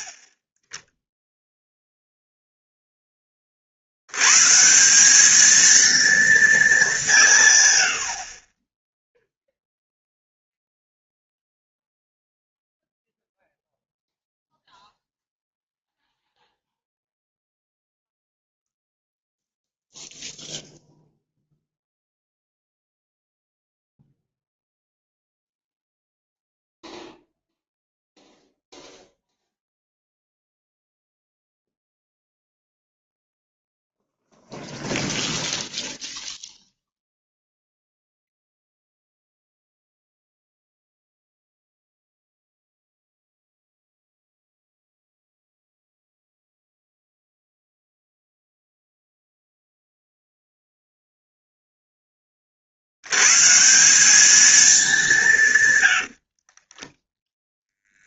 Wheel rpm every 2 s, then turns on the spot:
30, 0, 170, 200, 10, 0, 0, 0, 0, 0, 0, 0, 0, 0, 0, 0, 0, 0, 0, 0, 0, 0, 0, 0, 0, 0, 60, 210, 20.
56-58